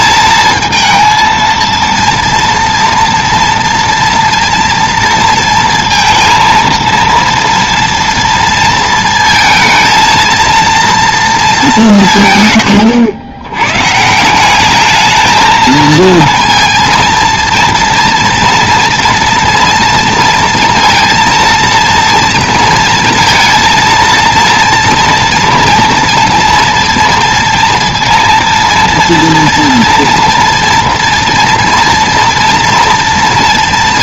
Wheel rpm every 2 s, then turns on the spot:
230, 230, 230, 230, 230, 230, 130, 190, 230, 230, 230, 230, 230, 230, 230, 230, 230.
none